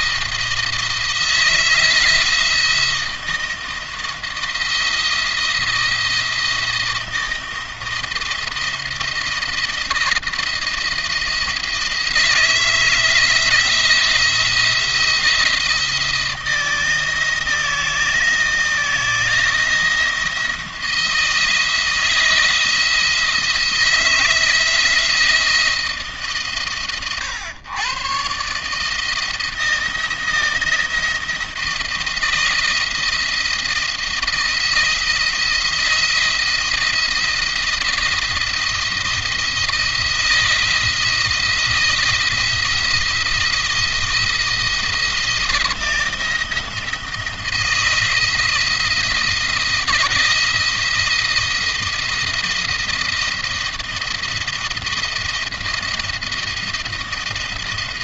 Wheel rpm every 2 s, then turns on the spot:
170, 170, 160, 160, 170, 170, 170, 170, 160, 170, 170, 170, 170, 130, 140, 170, 170, 170, 170, 170, 170, 170, 170, 170, 160, 170, 170, 170, 160.
none